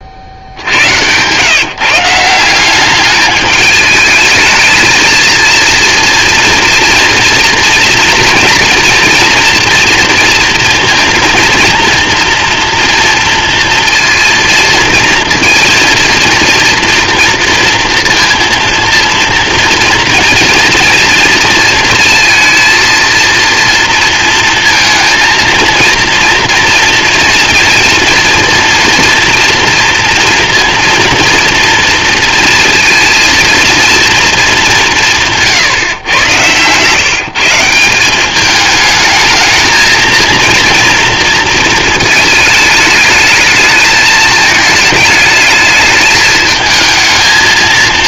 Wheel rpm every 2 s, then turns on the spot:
120, 210, 220, 230, 240, 230, 230, 230, 230, 230, 230, 230, 230, 230, 230, 230, 230, 170, 160, 220, 230, 210, 220, 220.
none